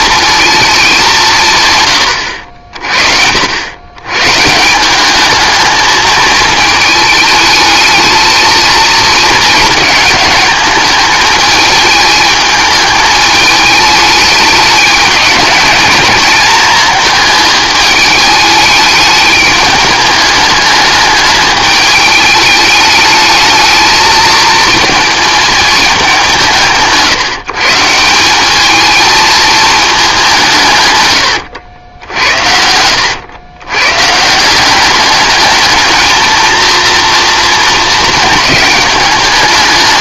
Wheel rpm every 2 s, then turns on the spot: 220, 60, 170, 220, 220, 210, 210, 210, 210, 210, 210, 210, 220, 160, 210, 150, 90, 180, 230, 210.
none